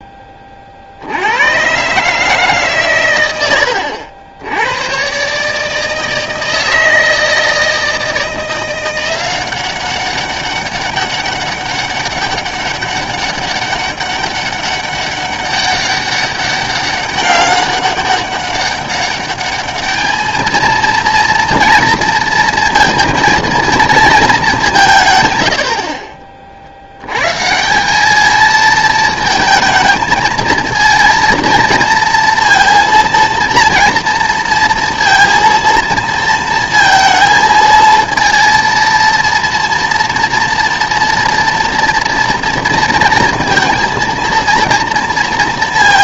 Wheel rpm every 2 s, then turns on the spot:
30, 140, 90, 160, 170, 200, 200, 200, 200, 200, 220, 230, 200, 50, 220, 220, 230, 230, 230, 230, 230, 230, 230.
none